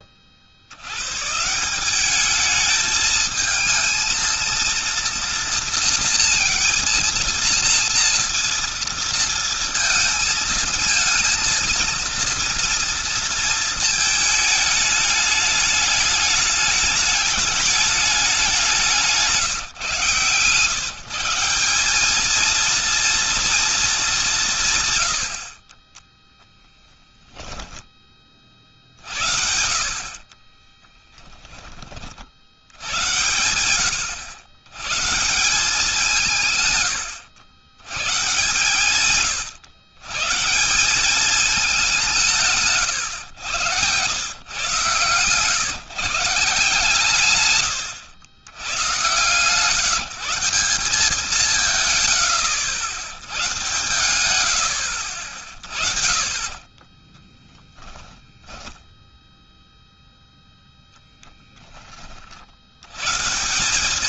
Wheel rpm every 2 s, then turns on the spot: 80, 210, 230, 230, 230, 230, 230, 210, 210, 180, 130, 220, 150, 0, 40, 40, 80, 90, 140, 120, 160, 150, 130, 170, 110, 180, 70, 100, 50, 10, 0, 70.
30-32 56-60